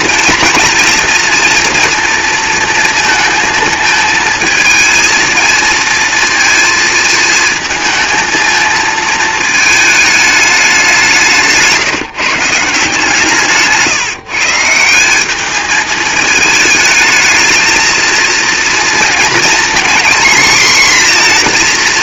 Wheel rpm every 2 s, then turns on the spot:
230, 230, 220, 230, 220, 200, 150, 160, 220, 230, 240.
none